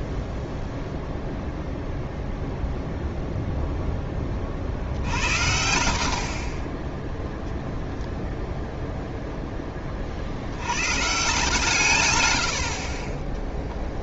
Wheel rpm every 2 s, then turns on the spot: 0, 0, 50, 20, 0, 110, 60.
none